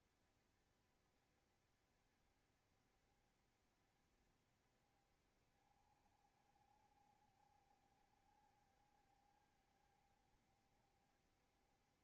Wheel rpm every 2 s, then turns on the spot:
70, 70, 60, 70, 70, 70.
none